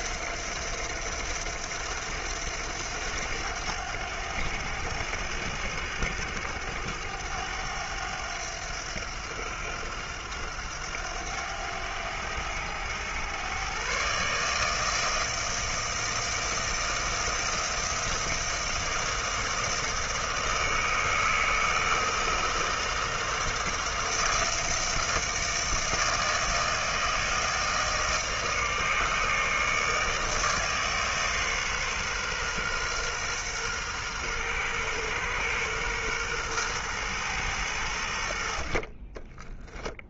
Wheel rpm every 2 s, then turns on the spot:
90, 100, 90, 90, 90, 90, 100, 150, 160, 160, 160, 160, 160, 160, 160, 150, 130, 120, 120, 50.
38-40